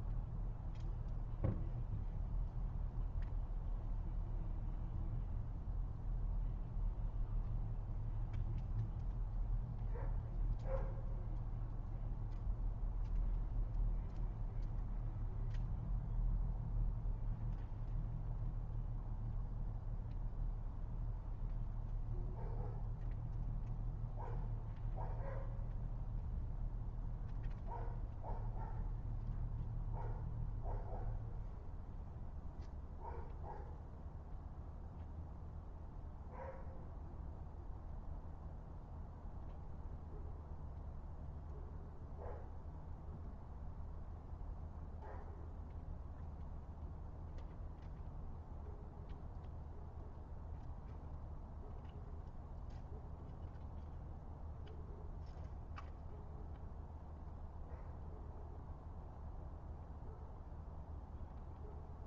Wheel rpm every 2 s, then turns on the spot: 0, 0, 0, 0, 0, 0, 0, 0, 0, 0, 0, 0, 0, 0, 0, 0, 0, 0, 0, 0, 0, 0, 0, 0, 0, 0, 0, 0, 0, 0, 0.
none